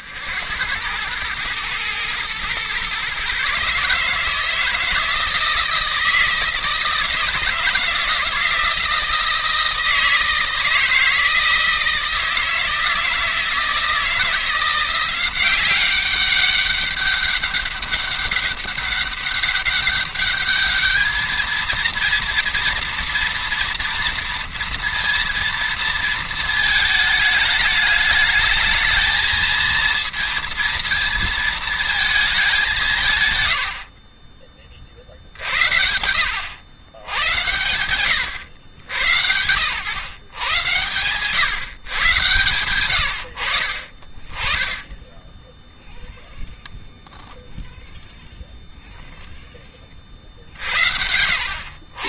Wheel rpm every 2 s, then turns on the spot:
100, 130, 160, 160, 160, 160, 160, 180, 200, 200, 210, 230, 230, 220, 210, 230, 170, 30, 90, 90, 110, 90, 10, 0, 10, 70.
44-46